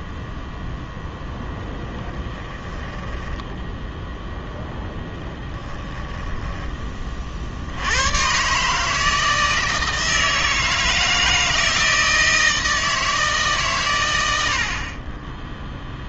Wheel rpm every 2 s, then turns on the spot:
0, 10, 0, 10, 140, 160, 160, 70.
2-4